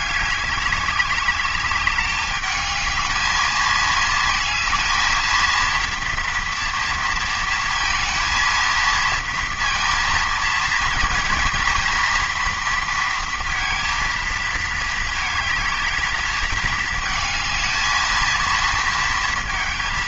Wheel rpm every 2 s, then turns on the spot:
200, 210, 220, 230, 230, 230, 230, 220, 220, 230.
none